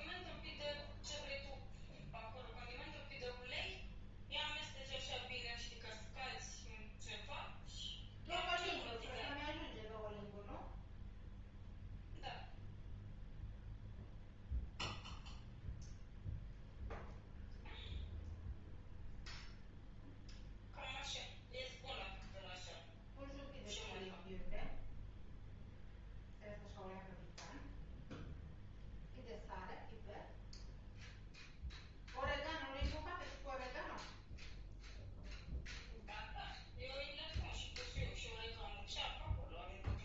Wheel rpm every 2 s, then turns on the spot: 0, 0, 0, 0, 0, 0, 0, 0, 0, 0, 0, 0, 0, 0, 0, 0, 0, 0, 0, 0.
none